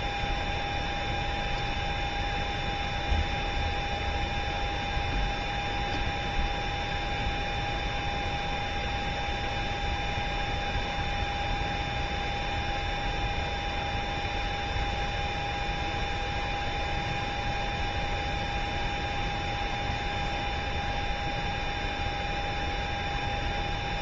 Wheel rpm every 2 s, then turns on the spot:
0, 0, 0, 0, 0, 0, 0, 0, 0, 0, 0, 0.
none